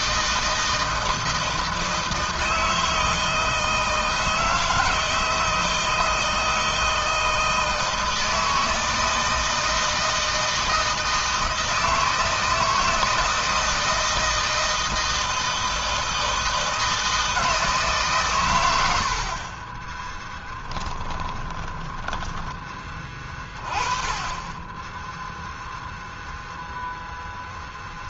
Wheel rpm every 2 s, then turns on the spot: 160, 160, 160, 160, 160, 160, 160, 160, 160, 110, 10, 20, 20, 0.
20-22